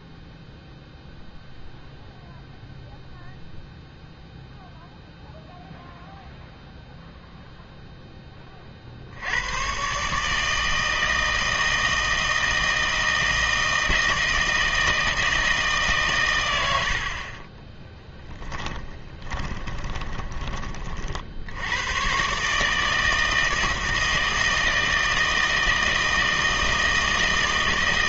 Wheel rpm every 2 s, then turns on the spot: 0, 0, 0, 0, 30, 160, 160, 160, 90, 10, 30, 150, 160, 160.
18-20